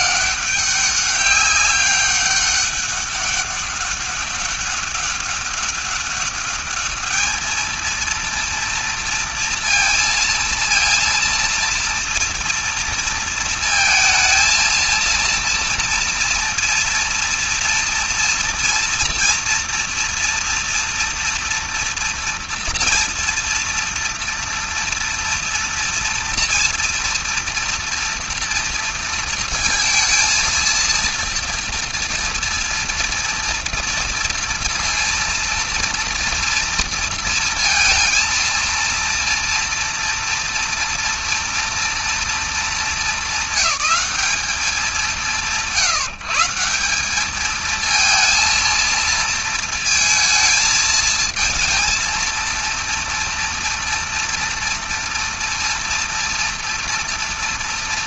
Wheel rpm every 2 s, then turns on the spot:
200, 200, 200, 210, 230, 230, 230, 230, 230, 230, 240, 230, 230, 230, 230, 230, 230, 230, 230, 230, 240, 220, 200, 180, 230, 220, 230, 230, 230.
none